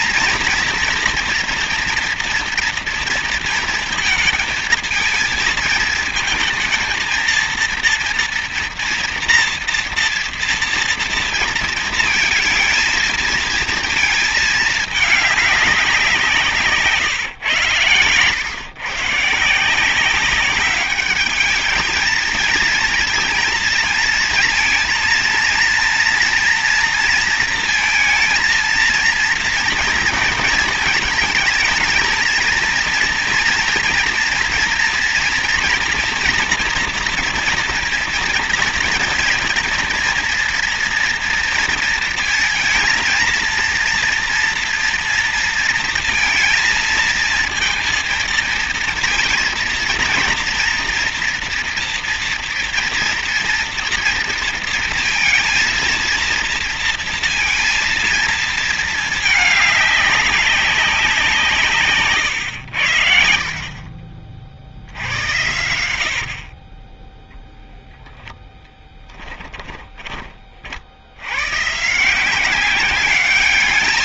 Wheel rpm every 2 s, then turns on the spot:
230, 230, 230, 230, 230, 230, 220, 220, 150, 140, 200, 230, 230, 230, 230, 230, 230, 230, 230, 230, 230, 230, 230, 230, 230, 230, 230, 230, 230, 220, 190, 90, 80, 20, 10, 70, 200.
68-70